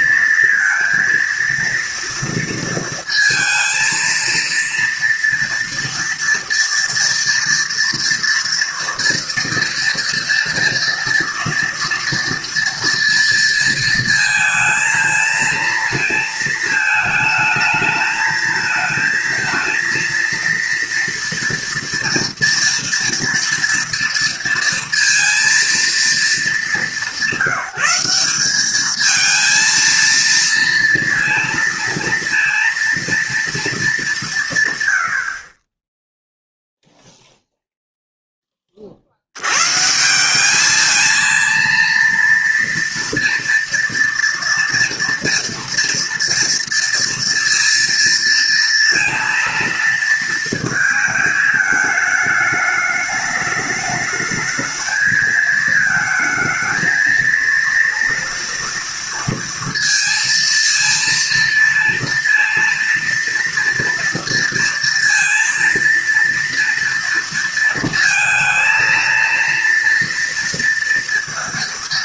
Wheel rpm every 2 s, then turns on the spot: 230, 230, 230, 230, 230, 230, 230, 220, 220, 220, 230, 230, 230, 200, 200, 230, 230, 130, 0, 20, 200, 230, 230, 230, 230, 230, 210, 220, 220, 230, 230, 230, 230, 230, 230, 230.
none